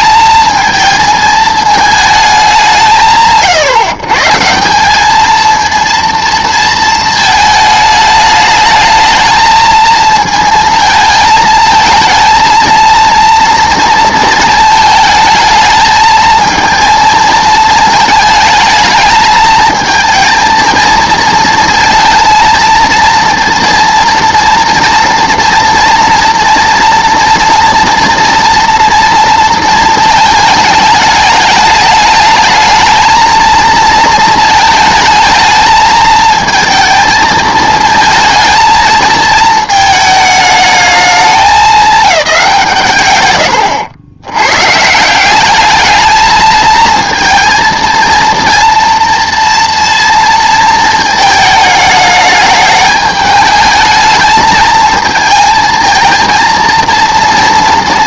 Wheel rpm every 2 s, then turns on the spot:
220, 180, 170, 230, 210, 230, 220, 220, 230, 220, 230, 230, 230, 240, 230, 220, 220, 220, 220, 220, 220, 170, 130, 220, 230, 230, 210, 220, 230.
none